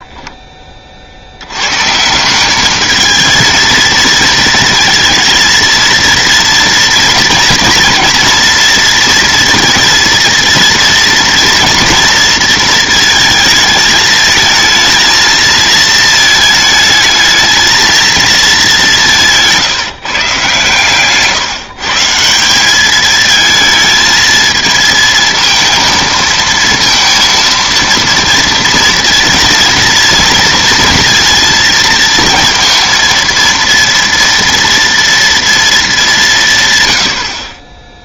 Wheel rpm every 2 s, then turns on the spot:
20, 200, 230, 230, 230, 240, 230, 220, 220, 210, 140, 190, 220, 230, 230, 230, 230, 230, 140.
none